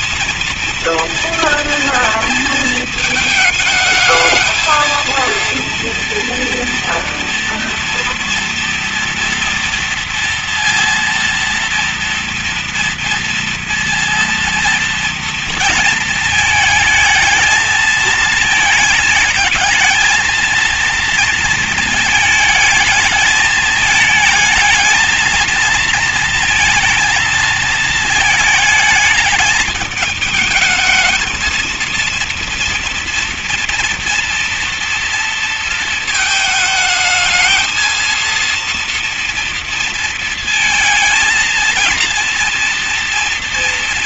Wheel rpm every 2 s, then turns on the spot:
230, 220, 220, 230, 240, 230, 230, 230, 220, 220, 230, 220, 220, 220, 220, 220, 240, 240, 220, 230, 220, 230.
none